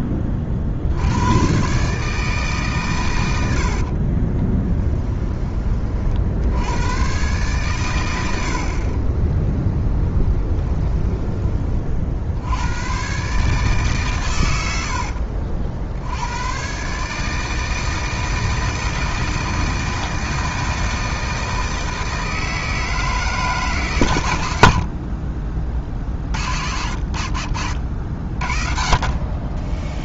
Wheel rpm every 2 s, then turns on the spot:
60, 130, 10, 90, 30, 10, 110, 80, 130, 160, 160, 160, 60, 80, 40.
4-6 10-12